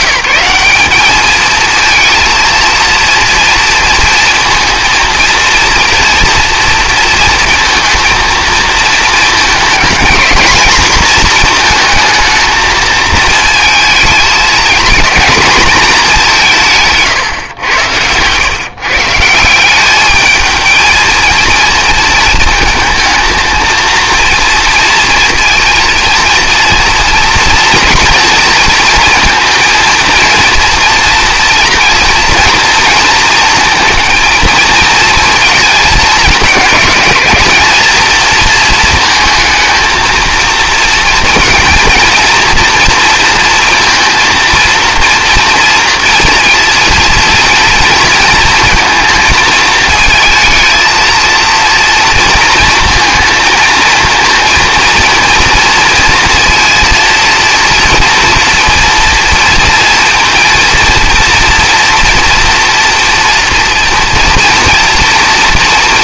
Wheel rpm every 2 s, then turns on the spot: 190, 230, 230, 230, 230, 230, 220, 230, 150, 140, 230, 220, 230, 230, 230, 240, 230, 230, 210, 230, 230, 230, 230, 230, 220, 220, 230, 230, 230, 230, 230, 230, 230.
none